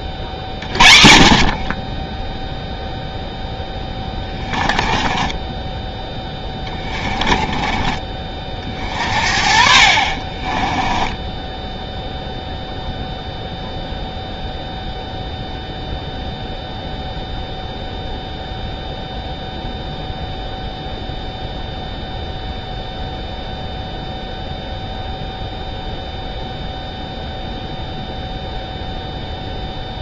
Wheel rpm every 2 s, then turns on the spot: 40, 0, 20, 20, 40, 30, 0, 0, 0, 0, 0, 0, 0, 0, 0.
4-8 10-12